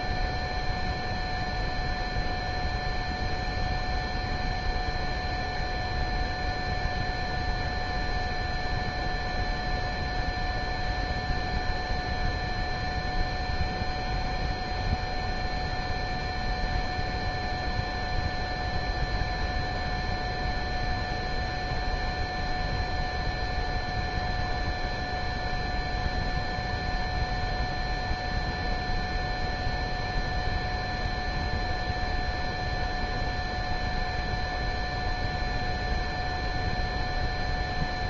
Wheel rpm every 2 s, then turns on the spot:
0, 0, 0, 0, 0, 0, 0, 0, 0, 0, 0, 0, 0, 0, 0, 0, 0, 0, 0.
none